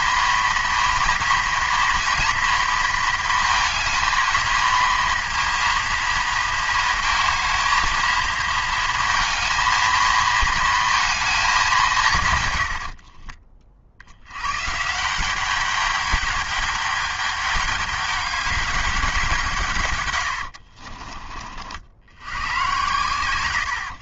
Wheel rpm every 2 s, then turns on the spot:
230, 230, 230, 220, 220, 220, 100, 130, 210, 210, 60, 100.
12-14 20-22